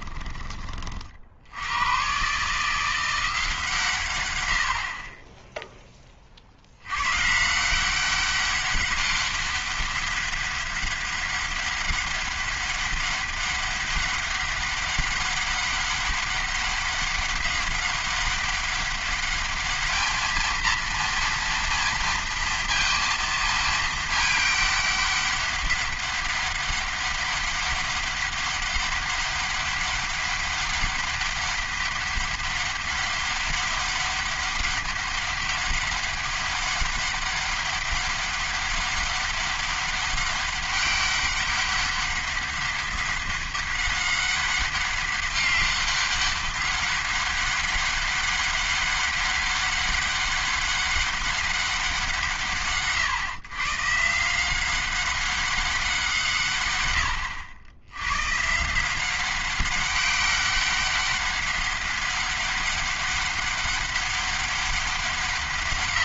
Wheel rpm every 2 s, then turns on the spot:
40, 170, 60, 100, 200, 200, 200, 200, 200, 200, 230, 230, 210, 200, 200, 200, 200, 200, 200, 200, 200, 200, 200, 200, 200, 200, 130, 190, 110, 170, 200, 200, 190.
none